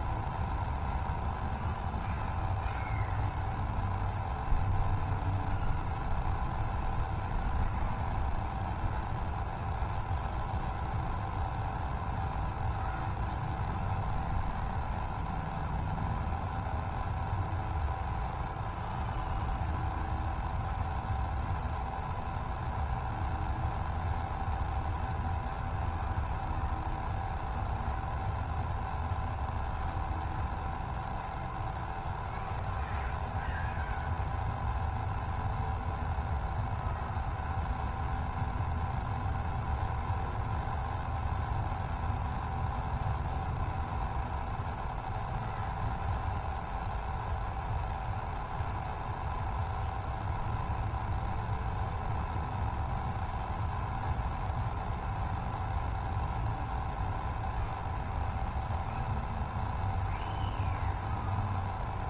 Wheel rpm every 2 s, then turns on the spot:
0, 0, 0, 0, 0, 0, 0, 0, 0, 0, 0, 0, 0, 0, 0, 0, 0, 0, 0, 0, 0, 0, 0, 0, 0, 0, 0, 0, 0, 0, 0.
none